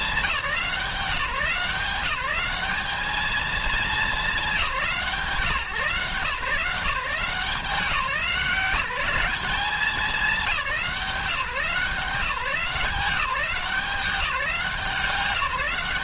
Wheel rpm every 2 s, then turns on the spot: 170, 210, 180, 150, 190, 160, 180, 180.
none